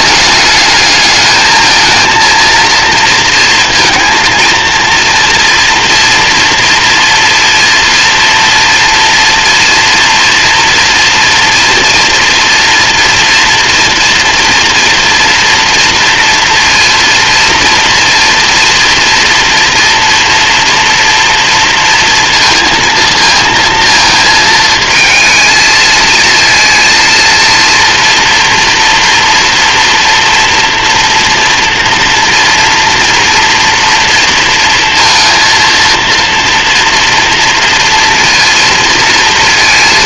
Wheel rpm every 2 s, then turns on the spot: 220, 230, 230, 240, 240, 240, 230, 230, 230, 230, 230, 230, 220, 230, 230, 230, 230, 230, 230, 230.
none